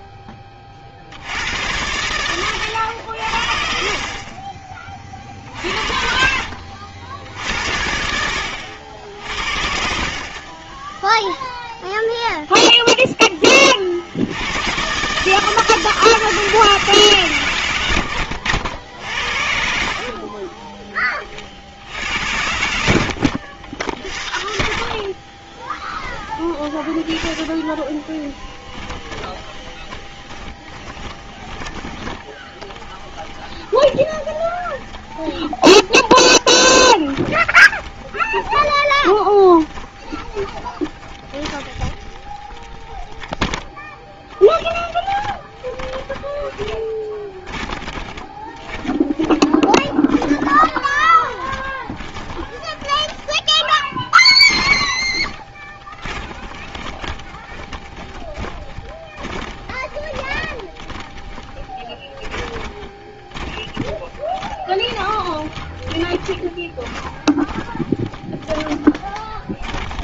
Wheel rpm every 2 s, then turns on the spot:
40, 90, 40, 60, 80, 20, 0, 130, 150, 80, 30, 60, 20, 10, 20, 30, 20, 10, 30, 20, 30, 30, 10, 20, 20, 20, 10, 30, 20, 20, 20, 20, 20, 20, 20.
0-2 8-12 22-26 28-70